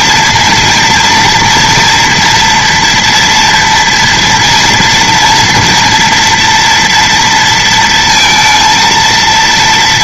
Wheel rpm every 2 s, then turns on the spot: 230, 230, 240, 240, 230.
none